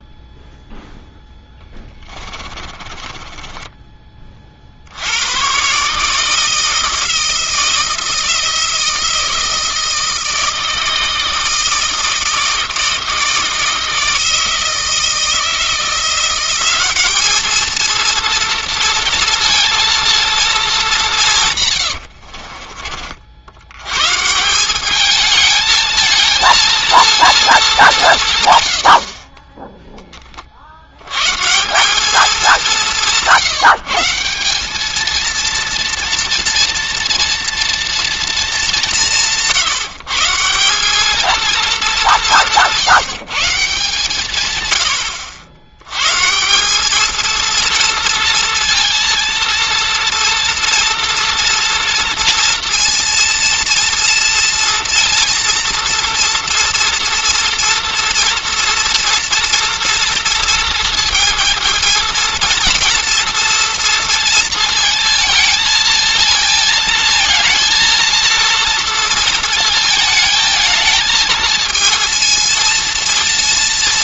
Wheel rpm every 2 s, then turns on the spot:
0, 20, 70, 160, 160, 160, 160, 160, 190, 230, 220, 40, 200, 230, 80, 90, 170, 220, 230, 200, 190, 160, 100, 220, 230, 230, 230, 230, 240, 230, 220, 230, 220, 220, 230, 220, 230.
2-4